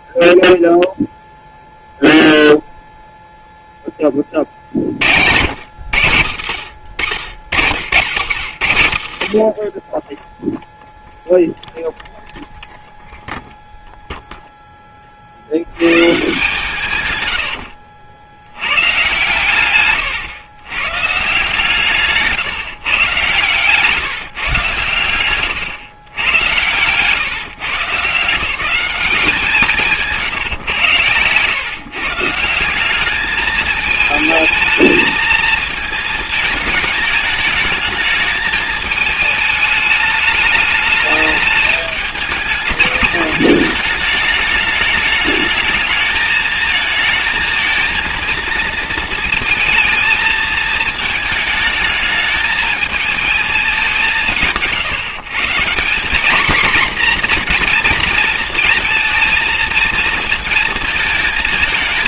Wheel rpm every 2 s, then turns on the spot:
0, 0, 50, 80, 90, 0, 0, 10, 140, 100, 120, 140, 130, 100, 180, 120, 180, 220, 220, 220, 210, 210, 210, 220, 230, 220, 220, 150, 240, 230, 220.
4-6